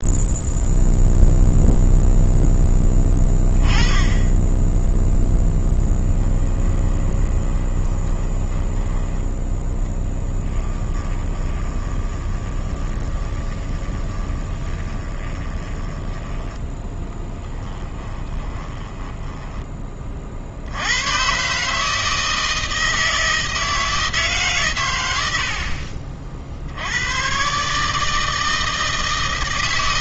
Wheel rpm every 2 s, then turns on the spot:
0, 10, 10, 10, 10, 10, 20, 20, 10, 10, 70, 160, 130, 70, 160.
6-16 18-20